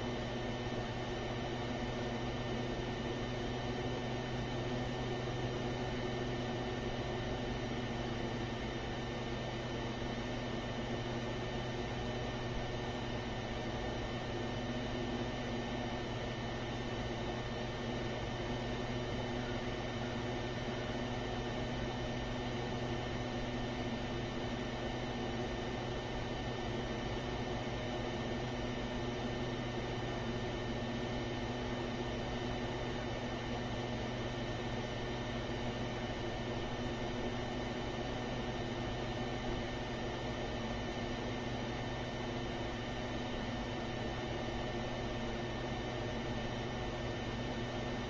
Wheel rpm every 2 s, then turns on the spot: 0, 0, 0, 0, 0, 0, 0, 0, 0, 0, 0, 0, 0, 0, 0, 0, 0, 0, 0, 0, 0, 0, 0, 0.
none